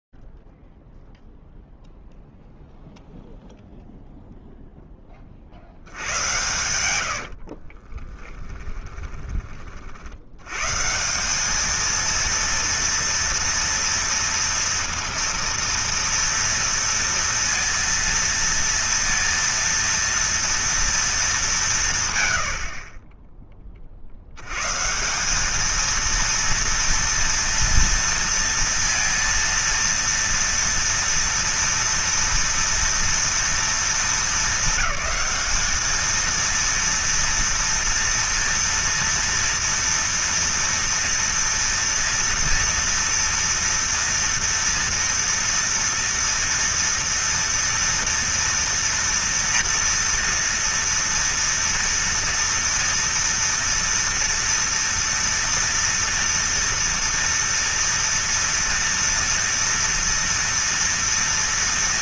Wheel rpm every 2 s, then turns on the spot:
0, 0, 0, 100, 10, 110, 230, 230, 230, 230, 230, 90, 120, 230, 230, 230, 230, 220, 230, 230, 230, 230, 230, 230, 230, 230, 230, 230, 230, 230, 230.
8-10